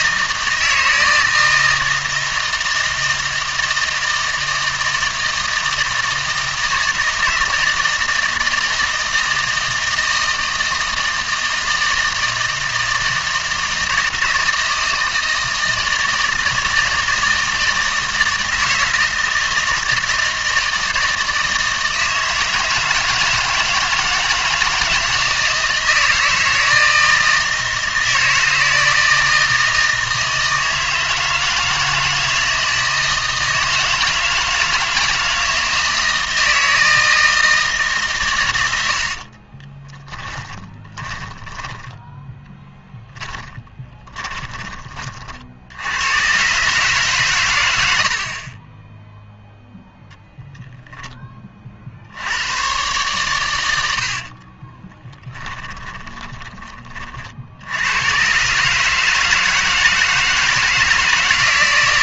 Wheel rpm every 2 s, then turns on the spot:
160, 160, 160, 160, 160, 160, 160, 160, 160, 160, 160, 160, 160, 160, 160, 160, 160, 160, 160, 90, 10, 10, 20, 130, 20, 0, 110, 30, 30, 140, 160.
38-44 54-56